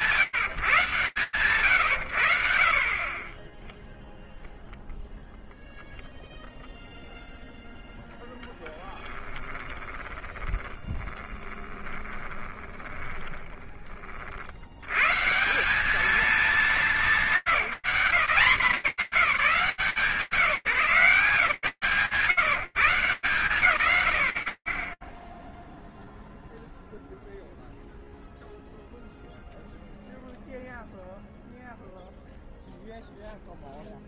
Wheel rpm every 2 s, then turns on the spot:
170, 100, 10, 0, 10, 20, 20, 80, 190, 180, 140, 160, 120, 0, 0, 0, 0.
10-14